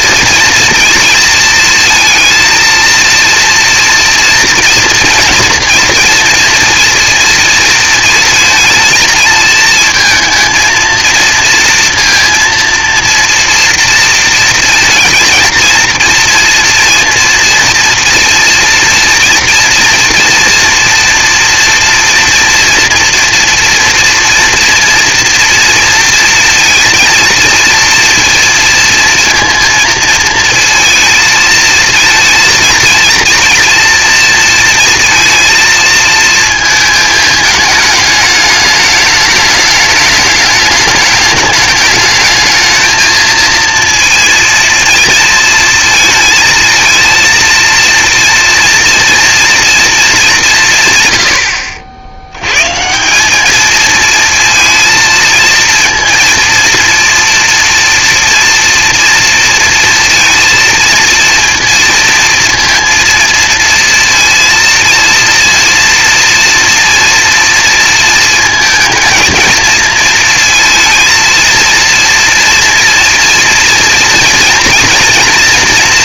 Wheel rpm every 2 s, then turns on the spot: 230, 230, 240, 230, 230, 230, 230, 230, 230, 230, 230, 230, 230, 230, 230, 220, 230, 230, 220, 210, 210, 220, 220, 220, 230, 170, 130, 230, 230, 230, 230, 230, 230, 230, 230, 230, 230, 240.
none